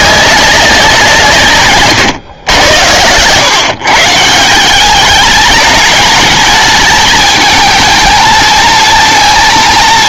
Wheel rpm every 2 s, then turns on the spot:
190, 100, 170, 210, 220.
none